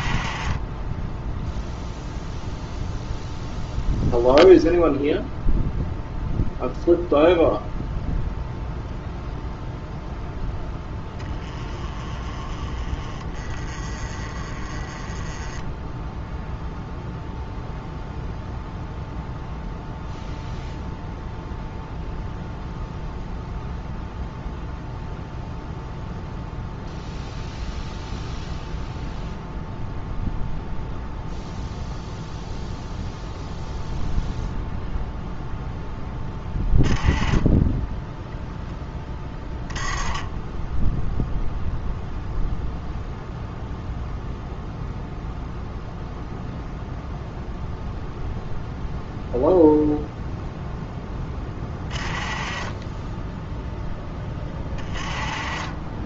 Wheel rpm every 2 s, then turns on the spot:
30, 0, 0, 0, 0, 10, 20, 20, 0, 0, 0, 0, 0, 0, 0, 0, 0, 0, 20, 10, 10, 0, 0, 0, 0, 0, 20, 20.
10-12